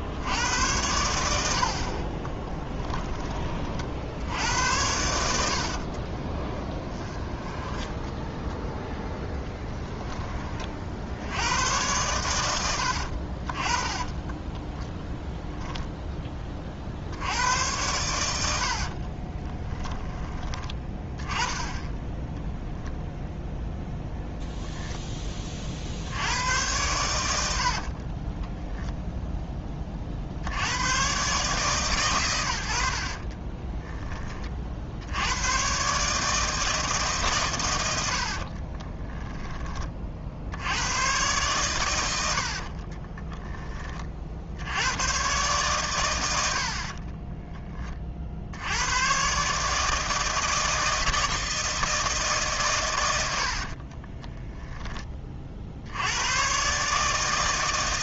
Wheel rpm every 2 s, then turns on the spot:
90, 10, 80, 20, 10, 30, 90, 10, 40, 60, 20, 0, 0, 90, 0, 90, 70, 40, 160, 30, 90, 50, 70, 80, 90, 160, 130, 10, 130.
2-4 6-10 14-16 18-20 38-40 42-44